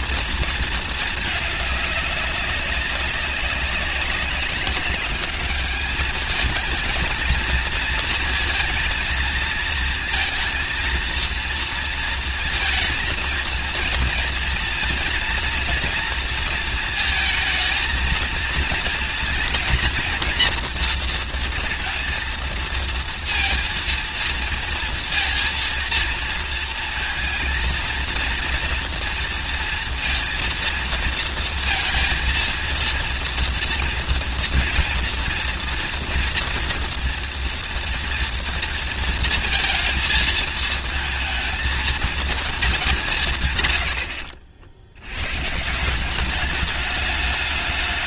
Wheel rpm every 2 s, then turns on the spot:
230, 200, 200, 220, 220, 230, 230, 230, 230, 230, 230, 230, 230, 230, 240, 230, 230, 240, 230, 230, 220, 200, 70, 210.
none